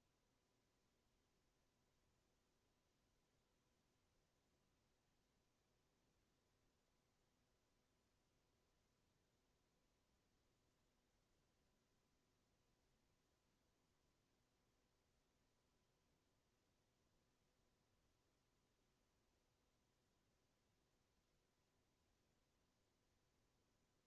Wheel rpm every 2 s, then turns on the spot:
0, 0, 0, 0, 0, 0, 0, 0, 0, 0, 0, 0.
none